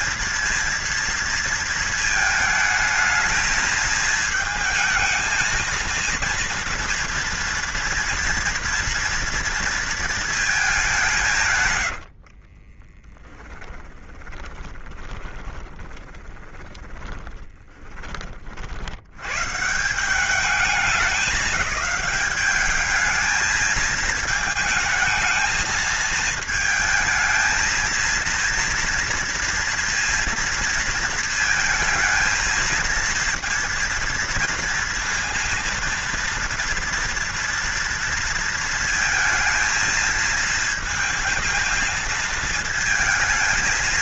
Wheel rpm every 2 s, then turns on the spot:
230, 220, 220, 230, 230, 210, 40, 20, 30, 50, 190, 210, 220, 220, 230, 230, 230, 230, 230, 230, 230, 220.
12-18